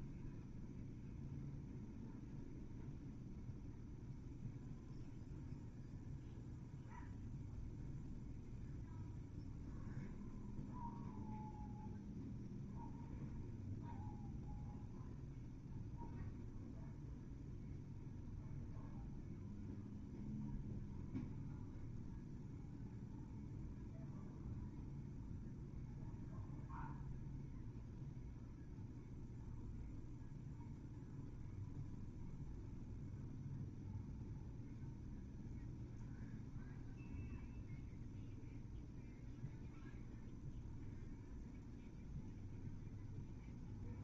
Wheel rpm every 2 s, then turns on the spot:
0, 0, 0, 0, 0, 0, 0, 0, 0, 0, 0, 0, 0, 0, 0, 0, 0, 0, 0, 0, 0, 0.
none